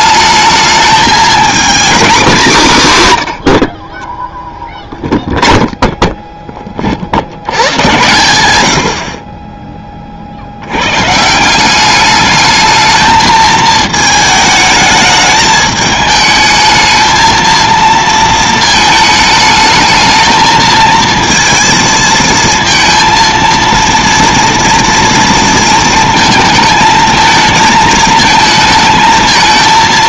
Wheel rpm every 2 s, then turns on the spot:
220, 220, 0, 20, 80, 90, 220, 220, 220, 220, 230, 230, 230, 220, 220.
none